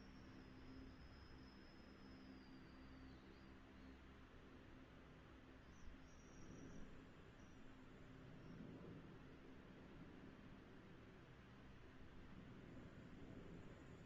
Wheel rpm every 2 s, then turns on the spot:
0, 0, 0, 0, 0, 0, 0.
none